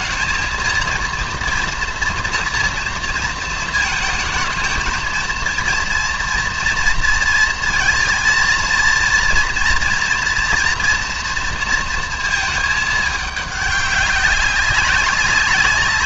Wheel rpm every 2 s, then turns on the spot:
220, 230, 220, 230, 230, 230, 220, 200.
none